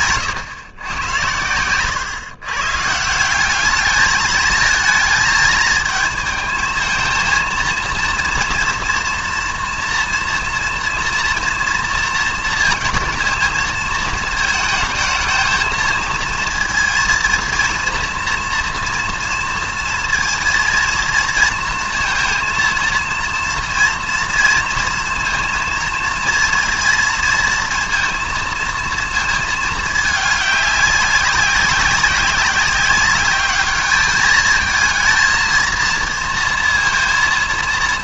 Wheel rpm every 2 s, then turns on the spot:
120, 130, 220, 220, 230, 240, 230, 230, 230, 240, 230, 230, 230, 230, 230, 210, 190, 220, 230.
none